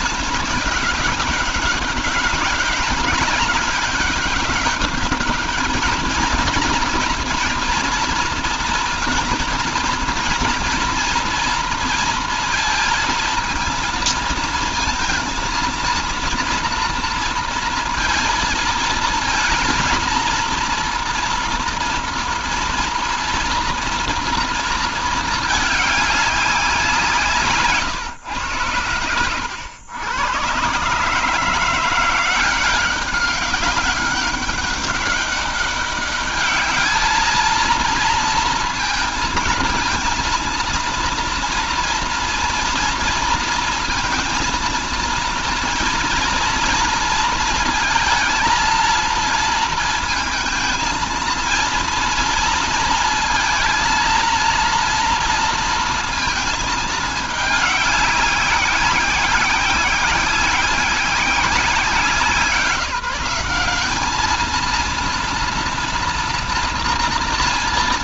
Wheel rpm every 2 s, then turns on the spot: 200, 200, 200, 220, 220, 230, 230, 220, 230, 230, 230, 230, 230, 180, 90, 130, 190, 200, 210, 230, 230, 230, 230, 230, 230, 230, 230, 230, 220, 190, 190, 180, 230, 230.
none